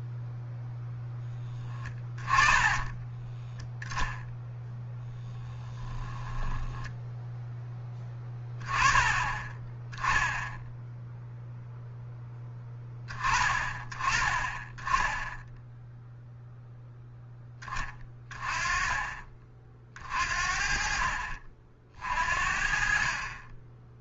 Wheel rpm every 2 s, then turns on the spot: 0, 20, 10, 10, 10, 0, 20, 10, 0, 30, 40, 40.
2-4 6-8